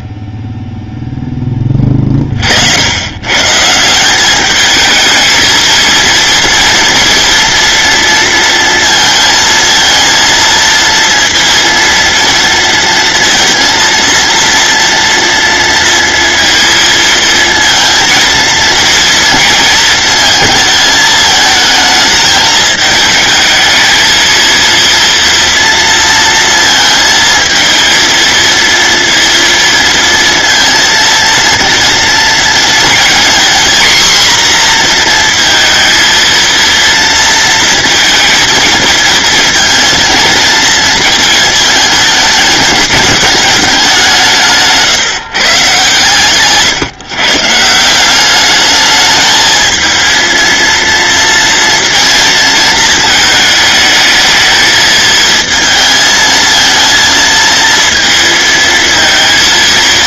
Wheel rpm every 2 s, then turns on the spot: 0, 80, 220, 230, 230, 230, 230, 230, 230, 230, 220, 220, 230, 220, 230, 230, 230, 240, 230, 230, 220, 220, 150, 140, 210, 230, 220, 220, 230, 230.
none